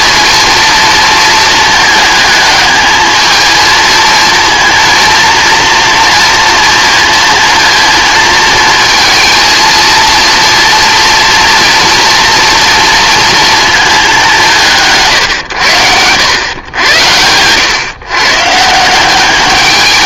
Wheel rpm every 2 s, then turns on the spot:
230, 220, 230, 230, 230, 230, 230, 180, 100, 150.
none